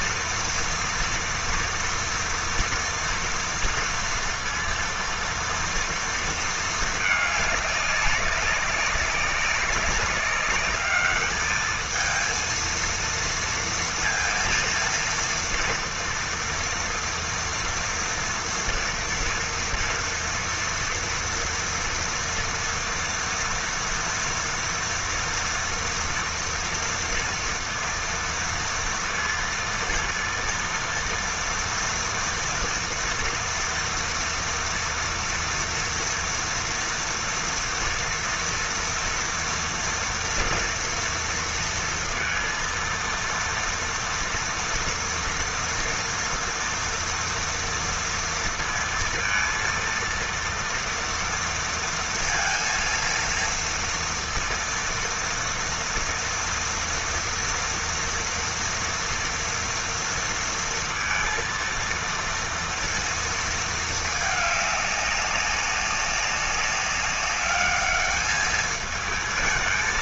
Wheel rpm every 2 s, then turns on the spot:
230, 230, 230, 210, 190, 210, 230, 230, 230, 240, 230, 230, 230, 230, 230, 230, 240, 230, 230, 230, 230, 230, 230, 230, 230, 230, 230, 230, 230, 230, 230, 230, 200, 200, 220.
none